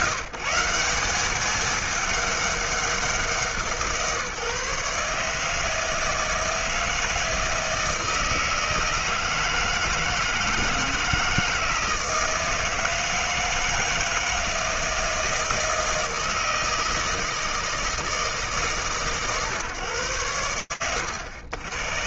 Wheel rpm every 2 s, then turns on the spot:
210, 170, 160, 160, 160, 160, 160, 160, 160, 140, 100.
none